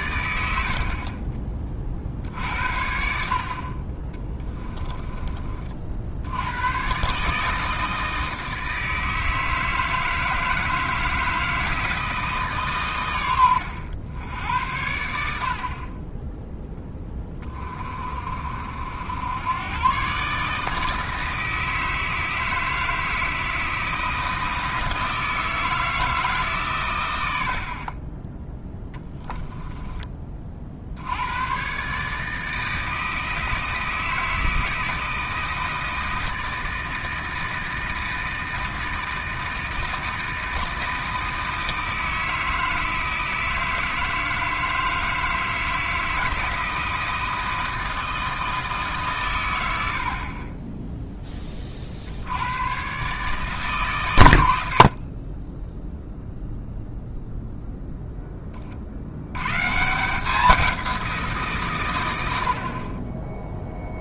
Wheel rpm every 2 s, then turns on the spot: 50, 60, 10, 120, 160, 160, 130, 80, 10, 70, 150, 160, 160, 120, 10, 70, 160, 160, 160, 160, 160, 160, 160, 160, 150, 10, 120, 60, 0, 40, 190, 40.
0-2 4-6 28-30